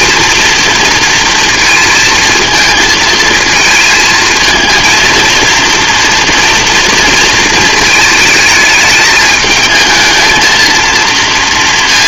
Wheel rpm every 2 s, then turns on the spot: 230, 220, 220, 230, 220, 230.
none